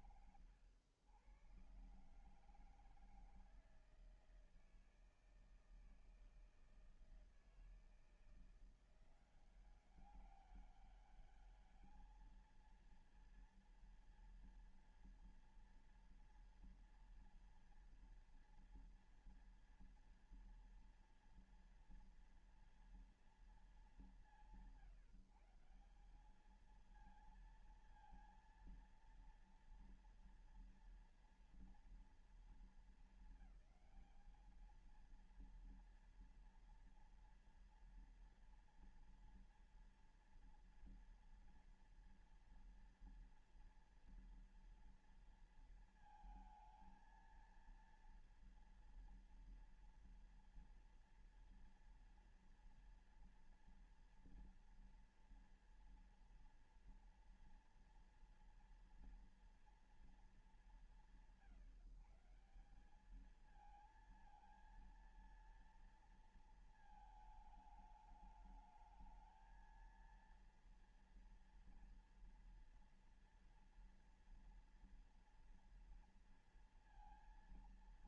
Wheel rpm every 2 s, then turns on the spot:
100, 160, 160, 160, 170, 200, 230, 230, 240, 230, 230, 230, 160, 220, 230, 240, 230, 230, 230, 230, 230, 230, 230, 220, 230, 230, 230, 230, 240, 230, 160, 190, 230, 220, 220, 230, 230, 230, 230.
none